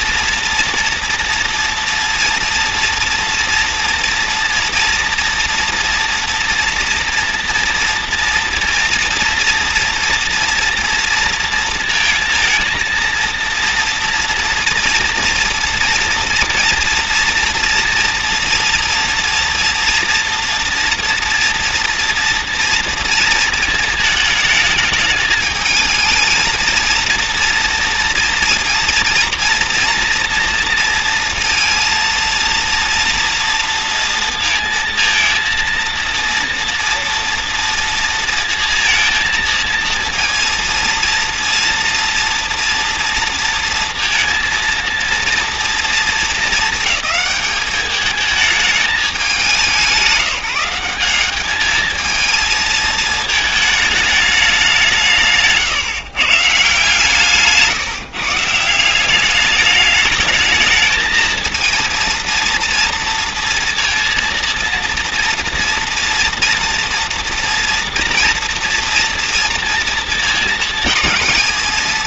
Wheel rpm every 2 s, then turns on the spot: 230, 230, 230, 230, 230, 230, 230, 240, 230, 230, 230, 230, 220, 230, 230, 230, 230, 230, 230, 230, 230, 230, 230, 220, 200, 200, 220, 160, 140, 190, 230, 230, 230, 230, 230, 220.
none